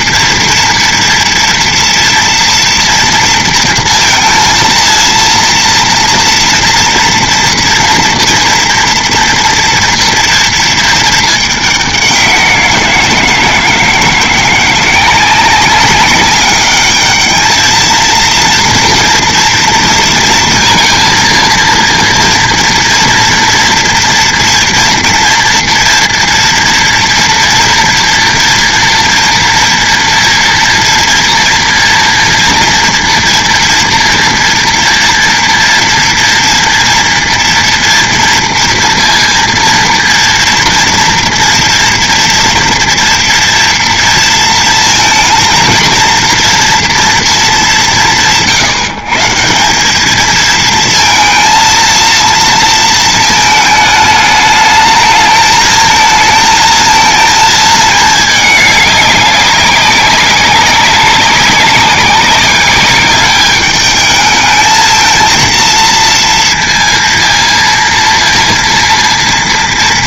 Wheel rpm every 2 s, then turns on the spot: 230, 230, 230, 230, 230, 230, 180, 170, 200, 230, 230, 230, 230, 240, 240, 240, 240, 230, 230, 230, 230, 230, 220, 230, 140, 220, 230, 210, 220, 210, 200, 200, 220, 230, 230.
none